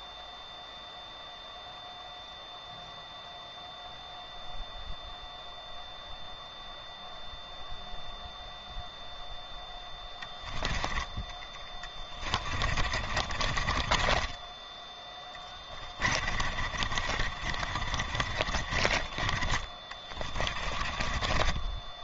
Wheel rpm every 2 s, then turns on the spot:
0, 0, 0, 0, 0, 20, 40, 20, 50, 40, 30.
12-22